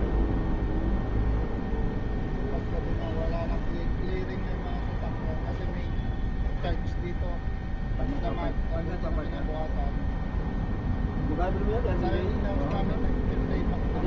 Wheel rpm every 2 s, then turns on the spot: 0, 0, 0, 0, 0, 0, 0.
none